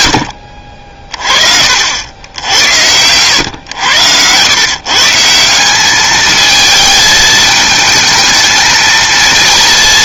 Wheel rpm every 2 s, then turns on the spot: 50, 90, 130, 220, 220.
none